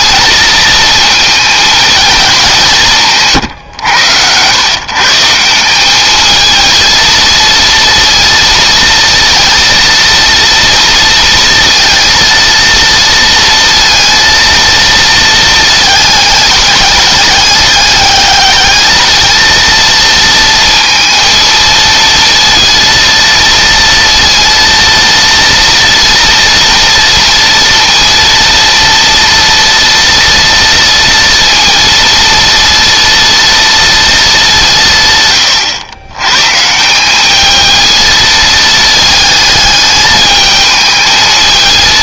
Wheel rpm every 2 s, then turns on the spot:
220, 170, 130, 230, 230, 230, 230, 230, 210, 220, 230, 230, 230, 230, 230, 230, 230, 160, 170, 220, 220.
none